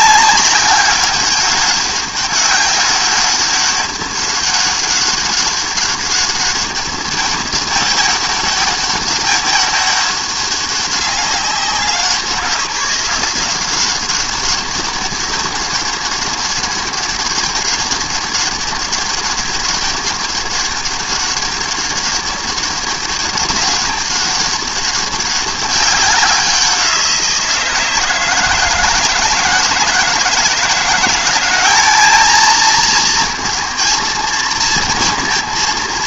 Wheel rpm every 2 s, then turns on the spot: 200, 200, 200, 200, 200, 200, 180, 200, 200, 200, 200, 200, 200, 180, 160, 170, 230, 230.
none